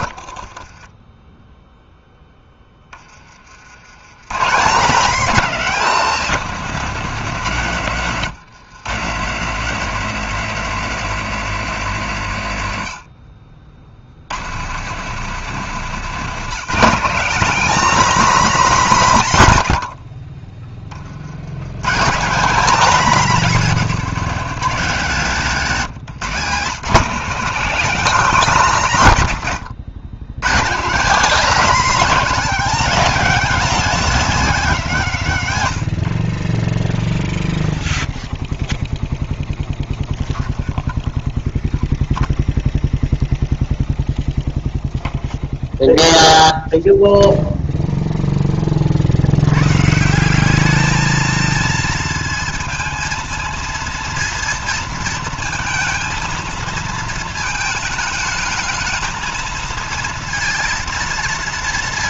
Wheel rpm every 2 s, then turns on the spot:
50, 10, 140, 220, 140, 200, 130, 130, 190, 230, 40, 210, 210, 170, 200, 140, 230, 210, 40, 0, 0, 0, 0, 0, 20, 190, 230, 230, 230, 220, 230.
0-2